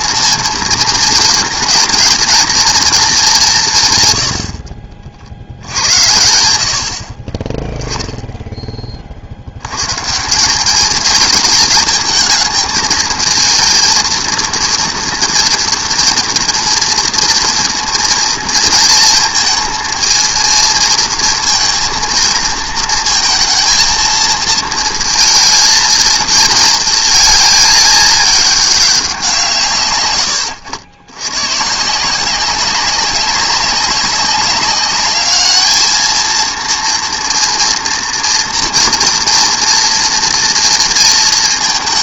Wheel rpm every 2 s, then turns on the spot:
230, 230, 60, 70, 20, 200, 220, 230, 230, 230, 230, 220, 230, 230, 200, 90, 190, 200, 230, 230, 230.
none